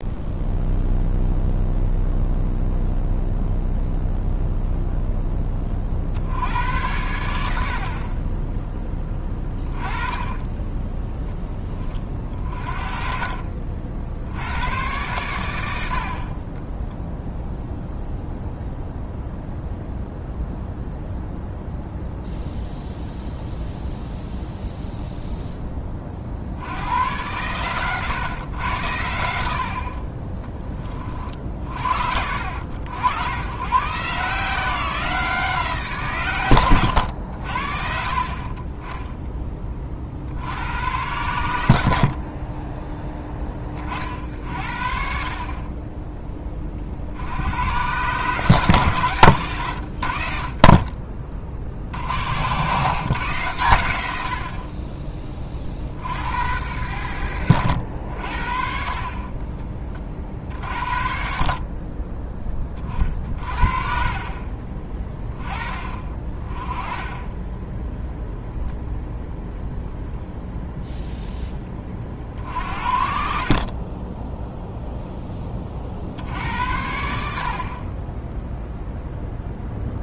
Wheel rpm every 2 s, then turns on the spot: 0, 0, 0, 90, 10, 10, 40, 110, 10, 0, 0, 0, 0, 90, 90, 30, 80, 170, 110, 20, 90, 10, 50, 50, 130, 40, 130, 30, 90, 50, 50, 30, 20, 20, 0, 0, 60, 0, 80, 0.
16-18 66-68